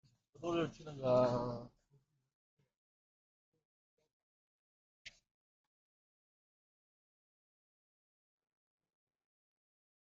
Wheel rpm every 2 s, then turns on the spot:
0, 0, 0, 0, 0.
none